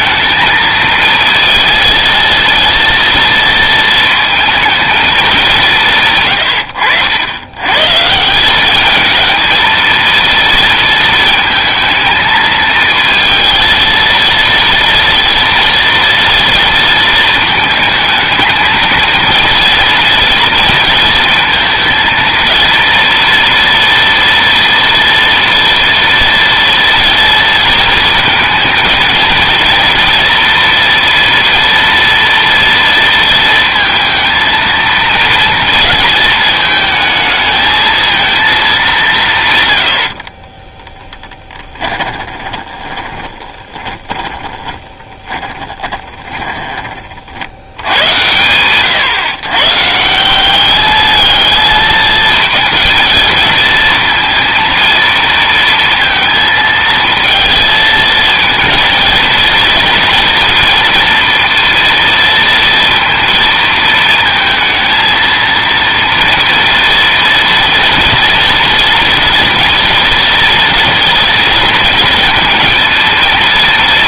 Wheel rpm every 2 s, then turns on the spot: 220, 230, 220, 70, 200, 230, 220, 230, 230, 230, 230, 230, 240, 230, 230, 230, 230, 230, 220, 200, 10, 20, 20, 30, 130, 210, 230, 230, 230, 230, 230, 230, 230, 230, 230, 240, 230.
40-46